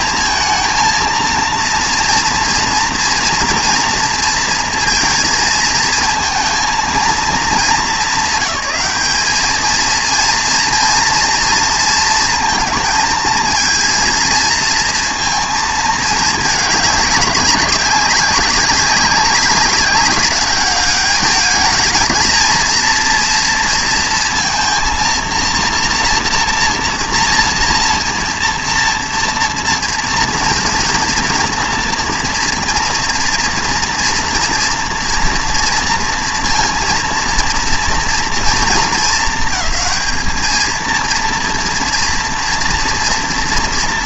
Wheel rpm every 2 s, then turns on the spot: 220, 230, 230, 230, 200, 230, 230, 230, 200, 200, 200, 230, 230, 230, 230, 230, 230, 230, 230, 230, 220, 230.
none